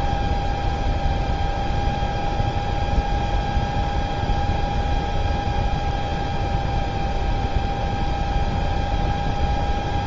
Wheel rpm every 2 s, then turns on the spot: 0, 0, 0, 0, 0.
none